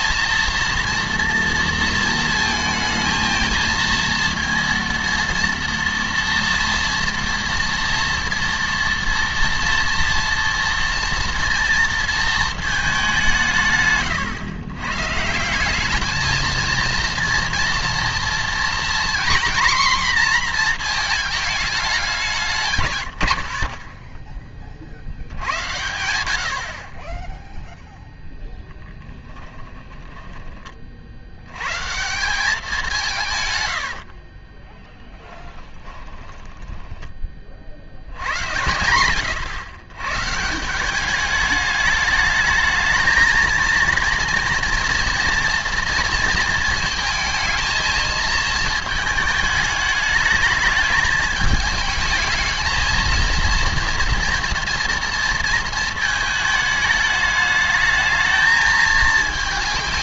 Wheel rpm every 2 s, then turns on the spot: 230, 220, 230, 230, 230, 230, 210, 120, 230, 240, 240, 160, 50, 40, 10, 30, 190, 30, 20, 90, 180, 220, 230, 230, 220, 210, 220, 230, 210, 220.
34-38